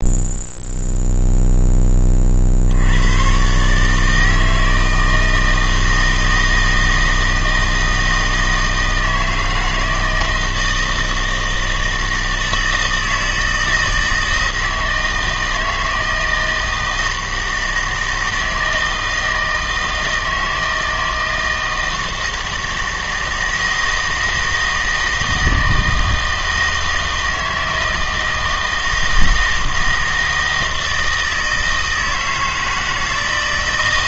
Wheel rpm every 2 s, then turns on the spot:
0, 60, 160, 160, 160, 160, 160, 160, 160, 160, 160, 160, 160, 160, 160, 160, 160.
none